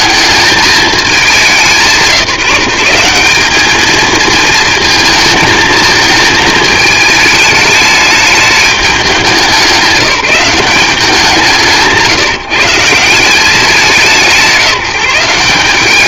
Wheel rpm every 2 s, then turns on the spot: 220, 190, 220, 220, 200, 190, 160, 170.
none